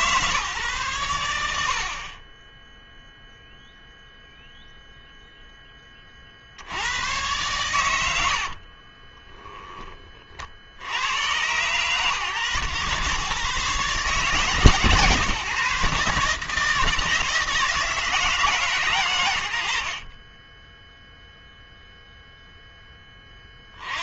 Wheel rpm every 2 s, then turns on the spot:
120, 0, 0, 90, 30, 70, 120, 140, 150, 130, 10, 10.
8-10